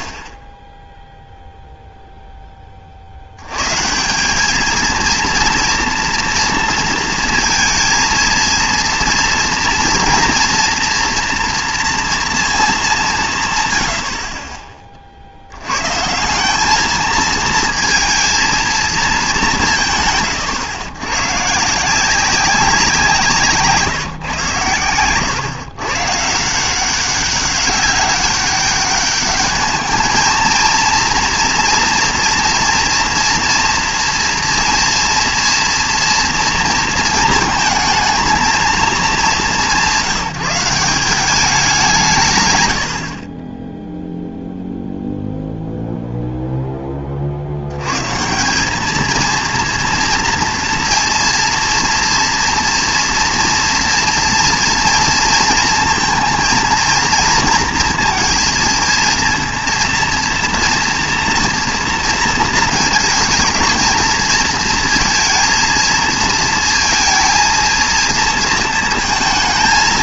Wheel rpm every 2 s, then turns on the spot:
0, 50, 230, 230, 230, 230, 190, 50, 220, 210, 120, 170, 110, 190, 210, 230, 230, 230, 230, 200, 190, 60, 0, 10, 200, 230, 230, 230, 230, 230, 230, 230, 230, 230, 220.
none